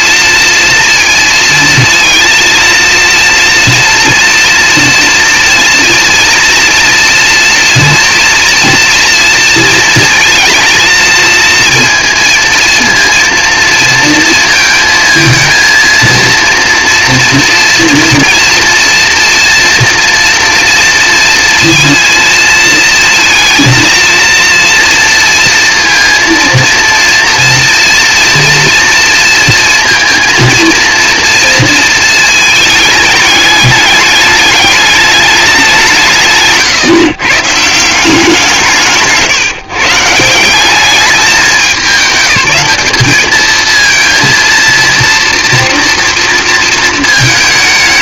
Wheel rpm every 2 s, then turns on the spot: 230, 230, 230, 230, 230, 220, 230, 230, 230, 240, 240, 230, 230, 230, 240, 230, 220, 210, 160, 170, 190, 190, 230, 230.
none